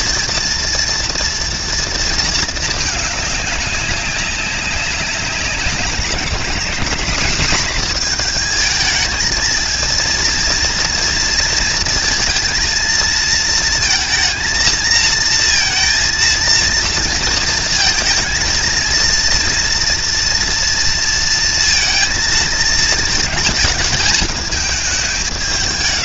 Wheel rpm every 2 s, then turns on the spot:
230, 210, 190, 220, 220, 230, 230, 230, 230, 230, 230, 220, 200.
none